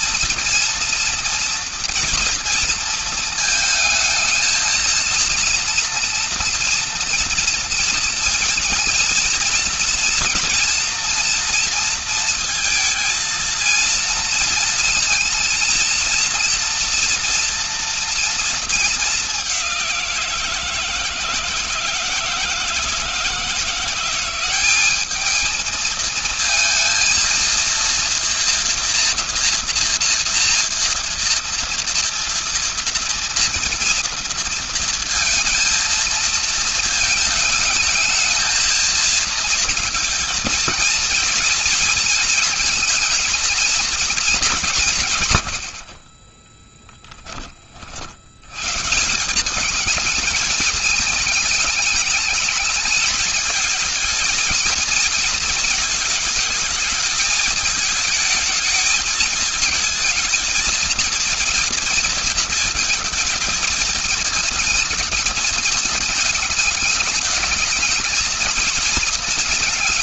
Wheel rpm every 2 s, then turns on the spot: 230, 220, 230, 230, 230, 230, 230, 230, 240, 200, 170, 170, 210, 230, 240, 230, 230, 230, 220, 230, 220, 230, 110, 30, 190, 210, 210, 220, 210, 220, 230, 220, 220, 210, 220.
none